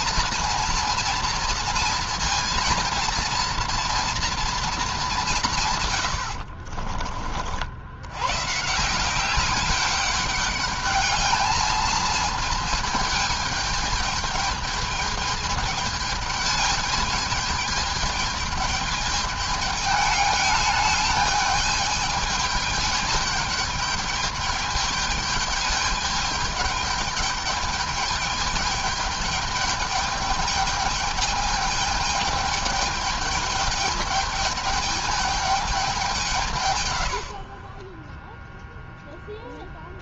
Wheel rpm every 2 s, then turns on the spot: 230, 230, 220, 50, 170, 210, 220, 220, 210, 210, 210, 210, 210, 200, 210, 210, 210, 210, 130, 0.
6-8